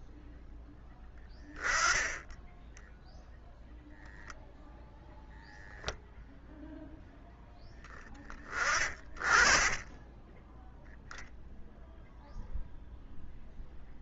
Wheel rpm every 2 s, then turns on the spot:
0, 10, 0, 0, 30, 0, 0.
8-10